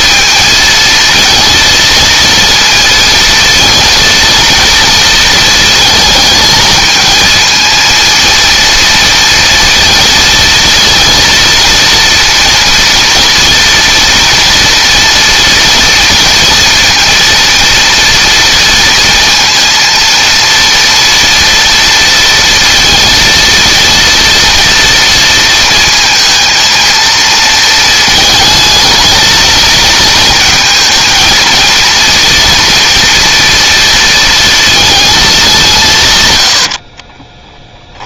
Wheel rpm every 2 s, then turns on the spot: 220, 230, 230, 220, 230, 230, 230, 230, 230, 230, 230, 230, 230, 220, 220, 220, 230, 230, 70.
36-38